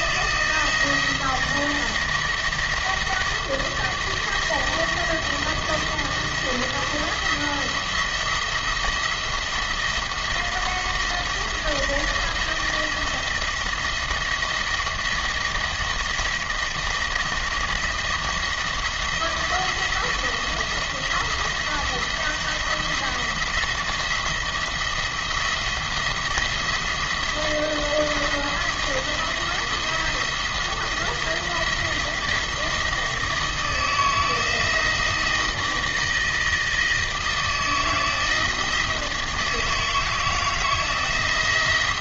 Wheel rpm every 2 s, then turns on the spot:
160, 170, 170, 170, 170, 170, 170, 170, 170, 170, 170, 170, 170, 170, 170, 170, 160, 160, 160, 160, 160.
none